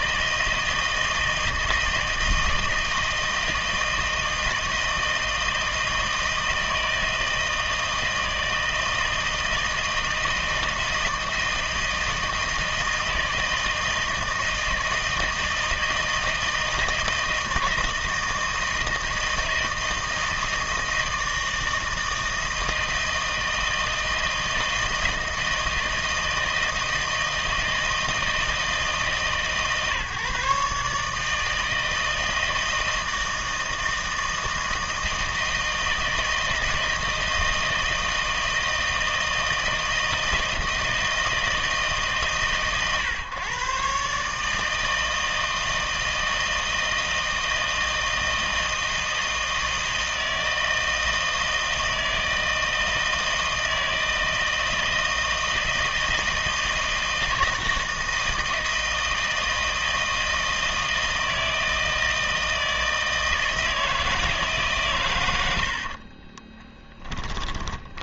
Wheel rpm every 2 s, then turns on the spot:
160, 160, 160, 160, 160, 160, 160, 160, 160, 160, 160, 160, 160, 160, 160, 150, 160, 160, 160, 160, 160, 130, 160, 160, 160, 160, 160, 160, 160, 160, 160, 160, 140, 10.
66-68